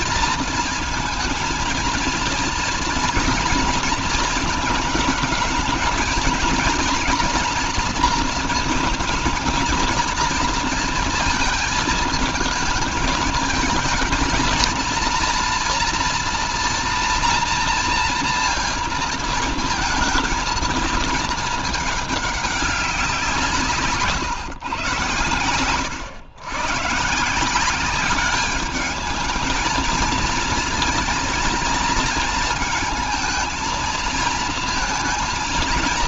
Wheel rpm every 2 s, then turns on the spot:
230, 230, 220, 230, 230, 230, 220, 230, 240, 230, 220, 200, 120, 130, 210, 230, 220, 230.
none